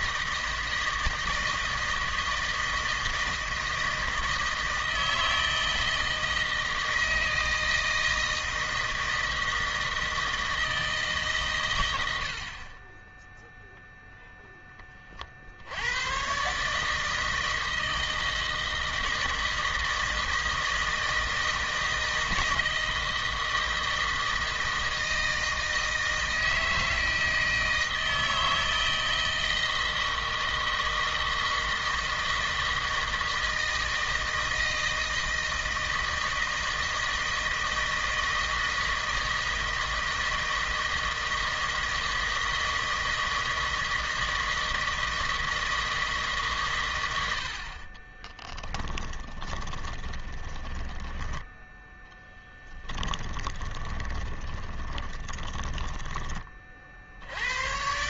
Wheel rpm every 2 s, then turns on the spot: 160, 160, 160, 160, 160, 160, 20, 20, 150, 160, 160, 160, 160, 160, 160, 160, 160, 160, 160, 160, 160, 160, 160, 110, 10, 20, 10, 20, 60.
48-52 54-56